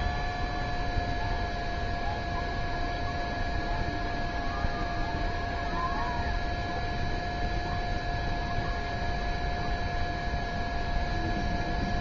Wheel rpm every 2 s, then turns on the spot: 0, 0, 0, 0, 0, 0.
none